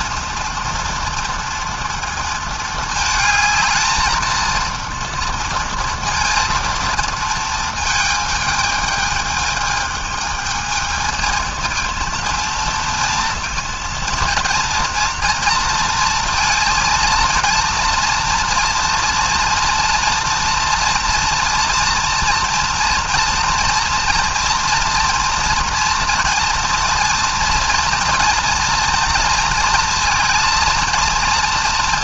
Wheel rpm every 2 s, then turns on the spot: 230, 220, 220, 230, 220, 220, 230, 230, 230, 230, 240, 230, 240, 230, 230, 230.
none